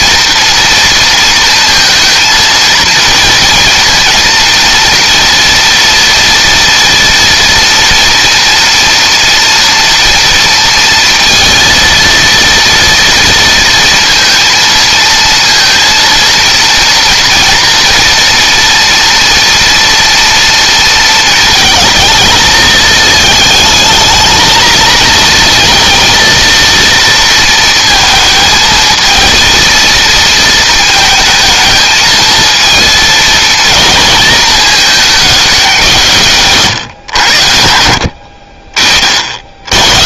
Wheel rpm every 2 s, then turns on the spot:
230, 230, 230, 240, 230, 230, 230, 230, 230, 230, 230, 220, 220, 230, 220, 220, 230, 210, 130, 50.
none